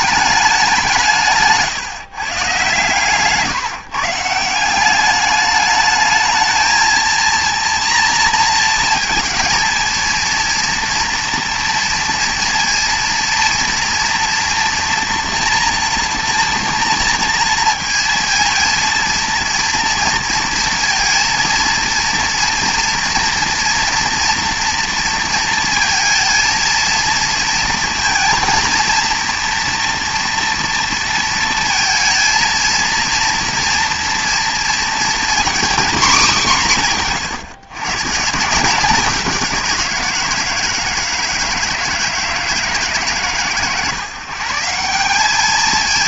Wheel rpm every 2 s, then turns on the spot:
190, 130, 170, 220, 230, 230, 230, 230, 240, 230, 230, 230, 230, 230, 230, 230, 230, 230, 190, 170, 160, 150, 150.
none